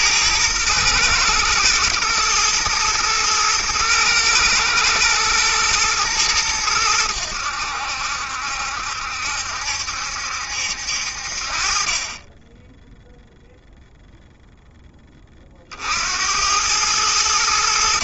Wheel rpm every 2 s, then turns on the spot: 110, 120, 110, 100, 70, 70, 10, 10, 100.
none